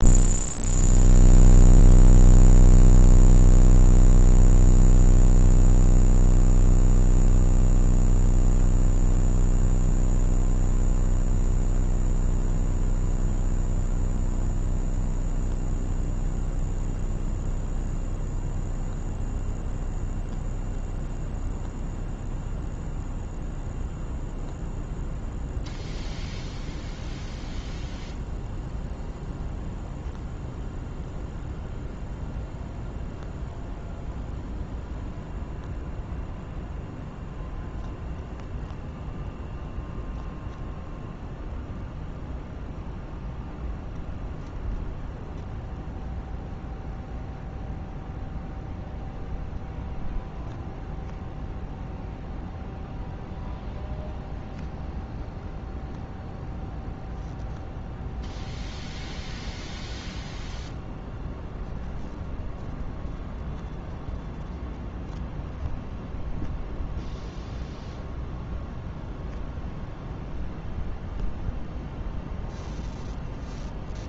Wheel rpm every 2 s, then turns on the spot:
0, 0, 0, 0, 0, 0, 0, 0, 0, 0, 0, 0, 0, 0, 0, 0, 0, 0, 0, 0, 0, 0, 0, 0, 0, 0, 0, 0, 0, 0, 0, 0, 0, 0, 0, 0, 0.
none